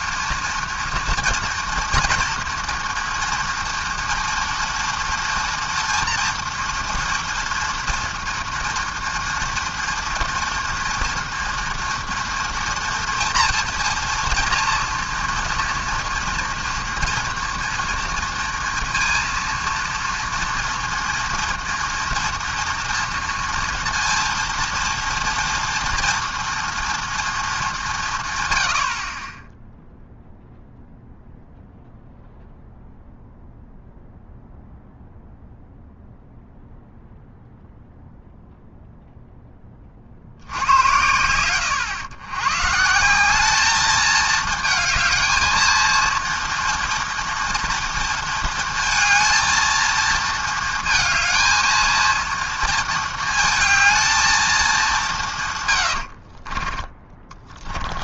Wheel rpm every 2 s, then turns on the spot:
230, 230, 230, 240, 230, 240, 230, 230, 230, 230, 230, 230, 230, 230, 90, 0, 0, 0, 0, 0, 80, 120, 220, 230, 230, 230, 230, 220, 40.
56-58